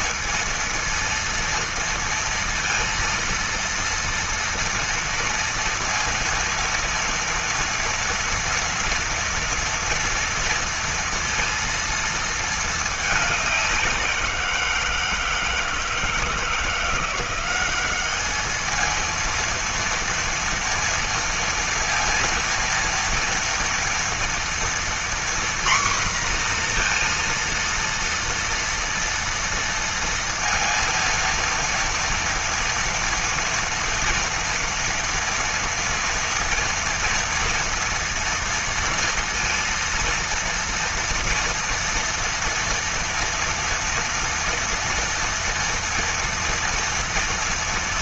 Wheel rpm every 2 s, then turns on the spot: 230, 230, 240, 230, 230, 230, 220, 170, 170, 220, 230, 230, 240, 240, 230, 230, 230, 240, 230, 230, 230, 230, 230, 230.
none